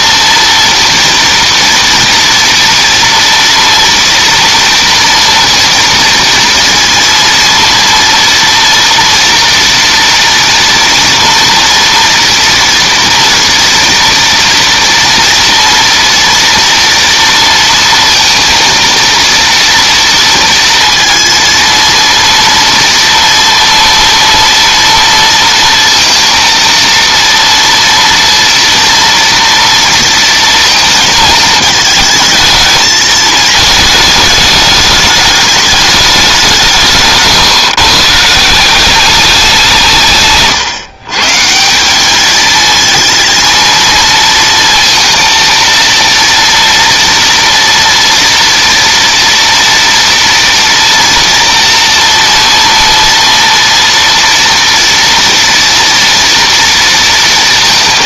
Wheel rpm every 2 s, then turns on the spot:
230, 230, 230, 230, 230, 230, 230, 240, 230, 230, 230, 230, 230, 230, 230, 230, 220, 210, 200, 150, 140, 200, 230, 230, 230, 230, 230, 230, 230.
none